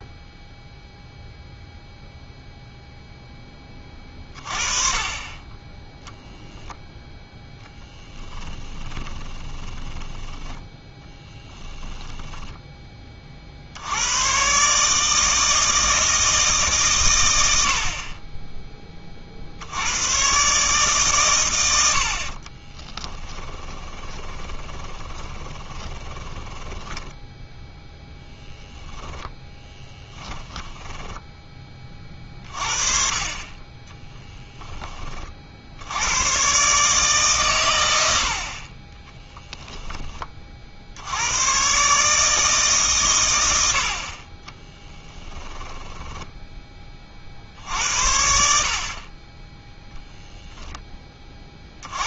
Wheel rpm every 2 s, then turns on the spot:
0, 0, 30, 0, 20, 10, 10, 140, 140, 20, 140, 20, 20, 10, 10, 10, 40, 20, 140, 30, 70, 140, 20, 20, 60, 10.
8-12 22-32 44-46